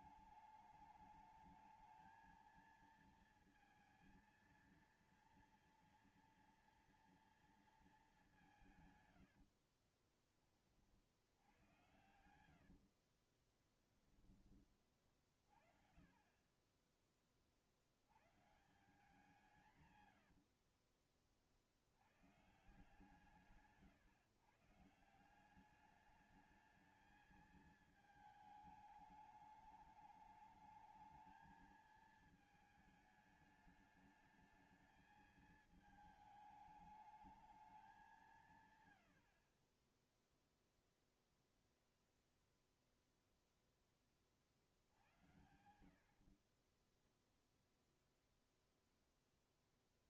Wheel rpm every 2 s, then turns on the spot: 210, 220, 230, 230, 180, 40, 80, 30, 30, 140, 80, 150, 140, 210, 220, 210, 220, 220, 210, 160, 10, 0, 40, 40, 0.
12-14 20-22